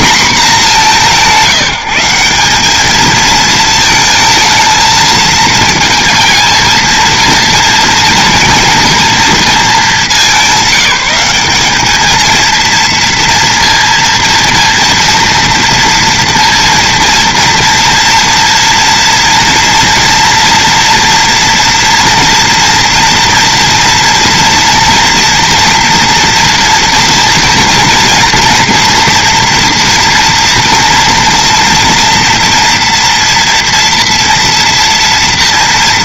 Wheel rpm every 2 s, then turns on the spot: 210, 200, 220, 230, 230, 200, 230, 230, 230, 230, 230, 230, 230, 230, 240, 230, 230, 240.
none